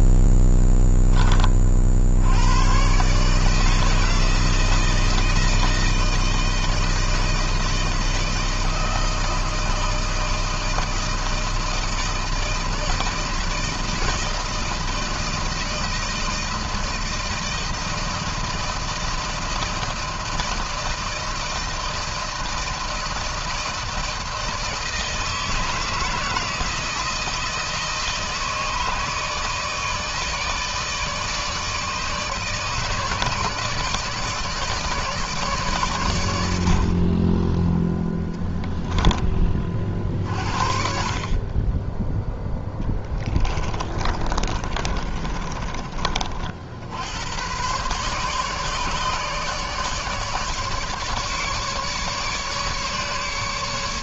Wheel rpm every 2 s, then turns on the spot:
0, 100, 160, 160, 160, 160, 160, 160, 160, 160, 160, 160, 160, 160, 160, 150, 150, 150, 70, 10, 40, 10, 30, 70, 150, 150, 150.
42-46